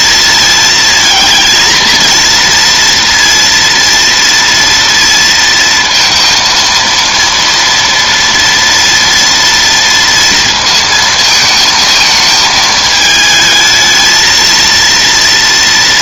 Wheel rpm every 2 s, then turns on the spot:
220, 230, 230, 230, 230, 230, 220, 230.
none